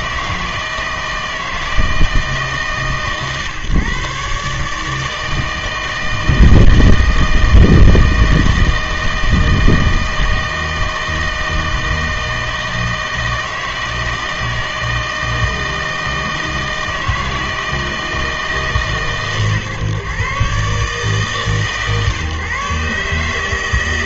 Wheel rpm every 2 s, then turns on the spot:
160, 140, 150, 160, 160, 160, 160, 160, 160, 160, 140, 140.
none